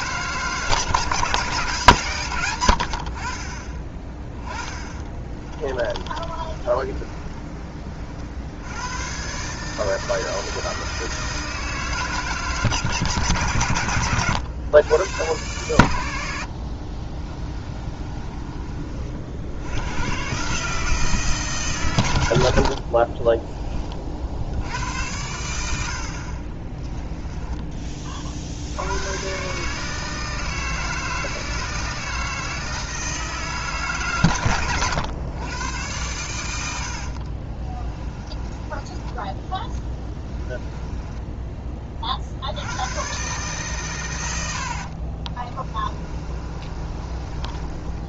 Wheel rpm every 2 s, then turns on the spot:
150, 80, 20, 20, 90, 160, 140, 120, 50, 40, 150, 40, 80, 20, 80, 160, 160, 110, 90, 20, 20, 100, 60, 30.
4-8 16-18 26-28 38-42 44-48